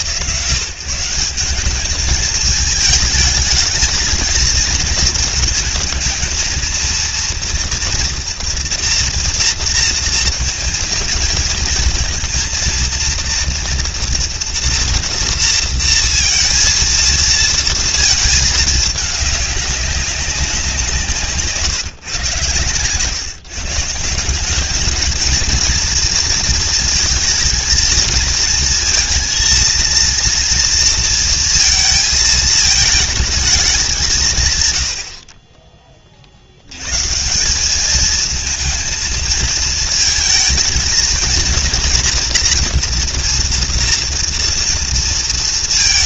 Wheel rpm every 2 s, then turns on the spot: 160, 210, 220, 230, 240, 230, 230, 230, 230, 210, 180, 130, 220, 230, 230, 230, 220, 110, 100, 220, 230, 240, 230.
22-24